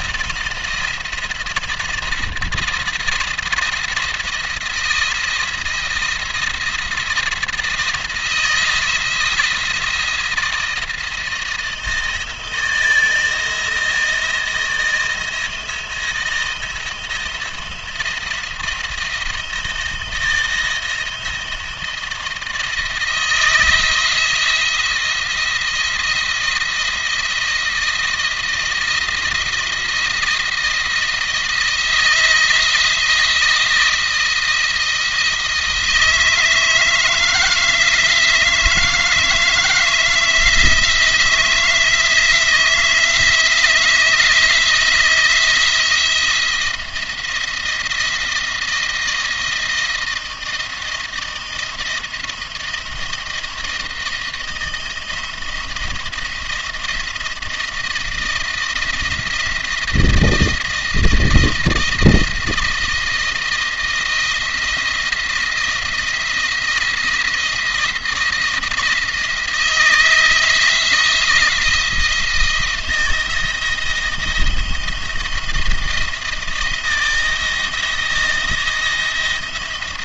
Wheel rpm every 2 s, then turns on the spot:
170, 170, 170, 160, 160, 170, 160, 160, 170, 170, 160, 160, 170, 170, 170, 170, 160, 170, 160, 160, 160, 160, 160, 170, 160, 160, 160, 160, 170, 170, 170, 170, 170, 170, 160, 160, 160, 170, 160, 170.
none